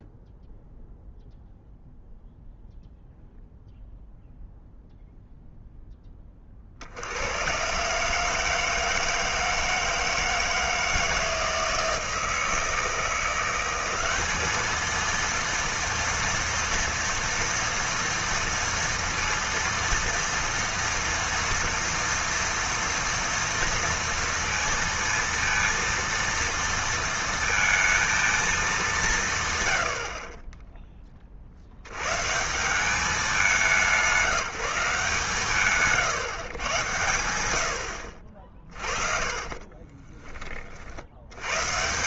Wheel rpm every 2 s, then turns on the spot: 0, 0, 0, 50, 160, 160, 160, 220, 230, 230, 230, 230, 230, 230, 200, 10, 150, 180, 110, 40, 40.
38-40